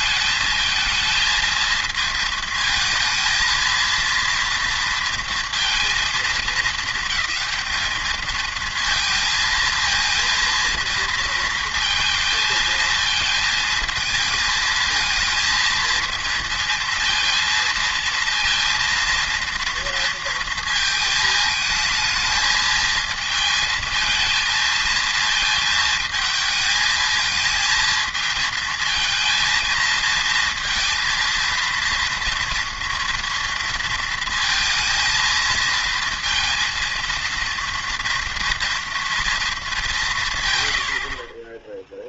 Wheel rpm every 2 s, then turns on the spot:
220, 230, 230, 220, 230, 230, 220, 220, 220, 230, 230, 220, 220, 220, 220, 230, 230, 230, 230, 230, 120.
none